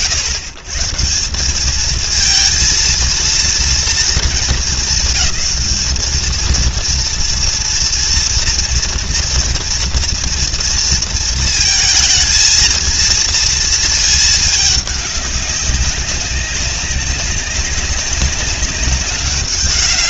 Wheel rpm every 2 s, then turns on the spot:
140, 230, 220, 230, 230, 230, 230, 210, 200, 190.
none